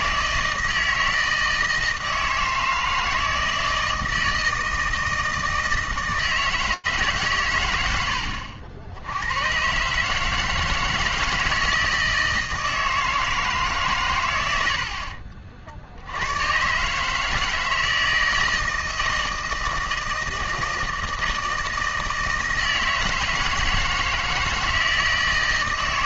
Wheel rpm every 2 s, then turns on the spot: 160, 160, 160, 160, 60, 160, 160, 80, 130, 160, 160, 160, 160.
none